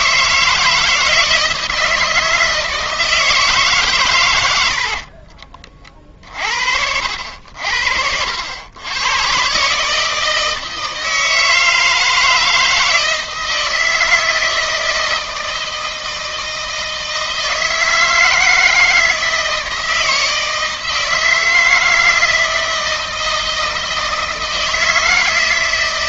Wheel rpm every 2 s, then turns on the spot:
160, 160, 60, 70, 110, 160, 160, 160, 160, 160, 160, 160, 160.
4-6